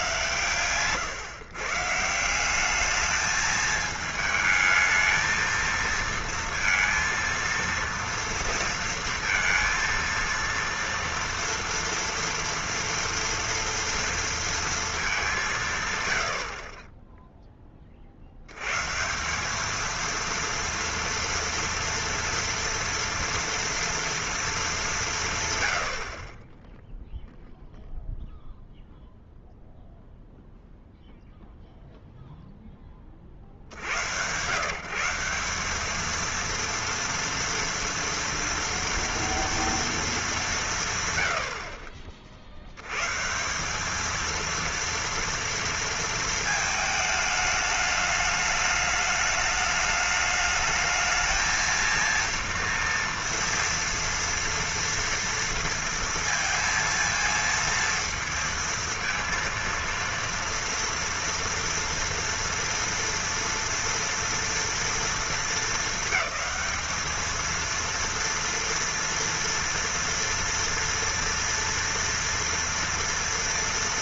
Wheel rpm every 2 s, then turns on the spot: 120, 200, 220, 230, 230, 230, 230, 230, 50, 110, 230, 230, 210, 10, 0, 0, 10, 140, 230, 230, 180, 80, 230, 220, 210, 210, 230, 230, 230, 230, 230, 230, 230, 210, 230, 230, 230.
0-2